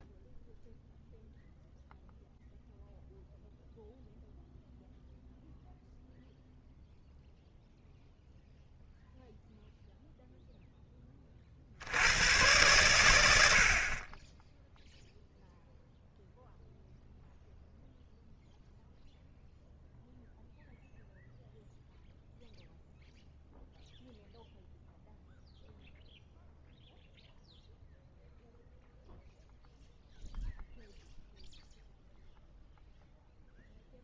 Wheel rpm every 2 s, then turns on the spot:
0, 0, 0, 0, 0, 0, 90, 30, 0, 0, 0, 0, 0, 0, 0, 0, 0.
none